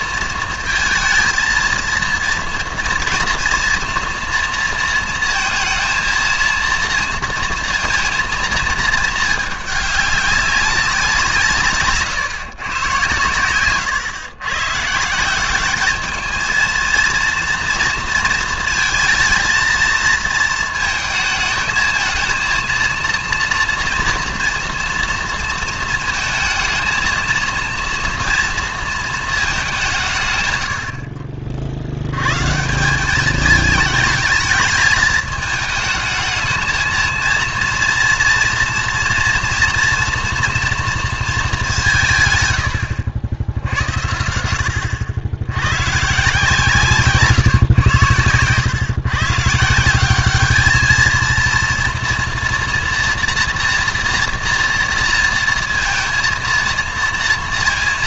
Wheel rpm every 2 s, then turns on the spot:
220, 230, 230, 230, 220, 200, 130, 130, 220, 230, 220, 230, 230, 220, 230, 120, 150, 210, 220, 240, 230, 100, 70, 150, 110, 210, 230, 230, 230.
none